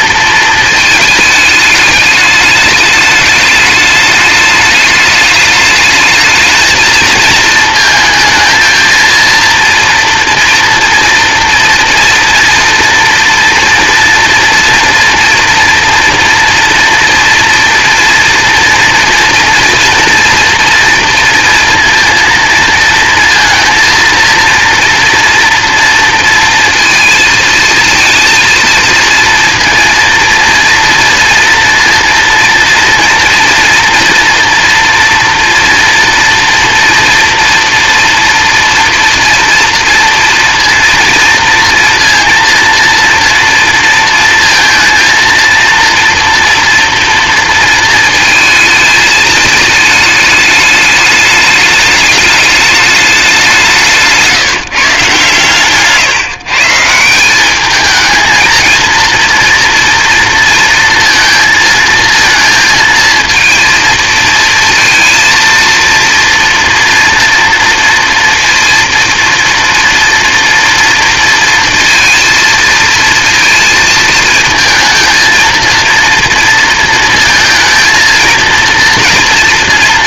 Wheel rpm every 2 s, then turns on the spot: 220, 210, 210, 220, 230, 240, 230, 230, 240, 230, 230, 230, 230, 230, 230, 230, 230, 240, 230, 230, 230, 230, 230, 230, 220, 210, 210, 150, 160, 230, 230, 230, 230, 230, 230, 230, 230, 220, 230, 230.
none